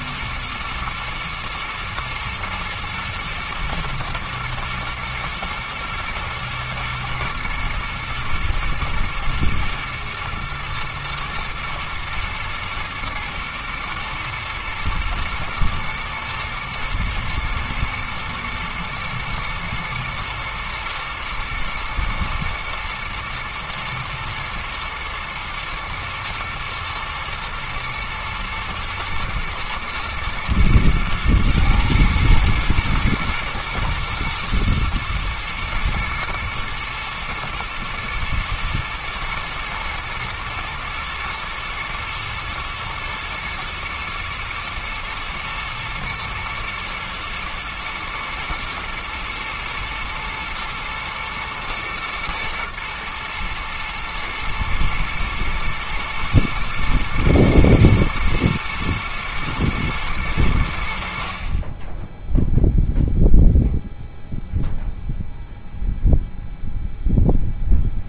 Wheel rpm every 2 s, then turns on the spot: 120, 110, 120, 110, 120, 110, 120, 110, 120, 110, 110, 120, 110, 120, 110, 120, 120, 110, 120, 110, 120, 110, 110, 120, 110, 110, 110, 110, 110, 110, 90, 0, 0, 0.
none